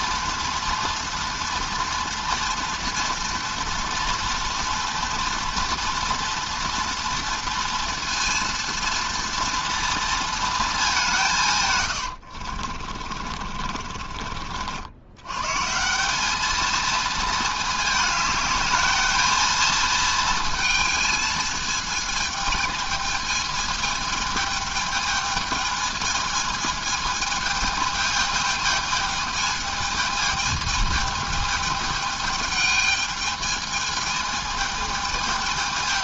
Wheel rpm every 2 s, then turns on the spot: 230, 230, 230, 230, 230, 220, 40, 70, 220, 210, 220, 220, 220, 220, 220, 220, 220, 220.
12-14